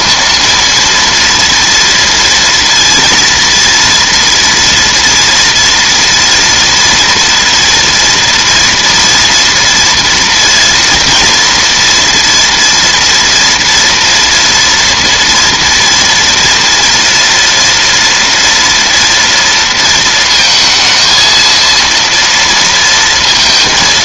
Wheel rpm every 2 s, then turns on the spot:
230, 230, 230, 230, 230, 230, 230, 230, 230, 230, 220, 230.
none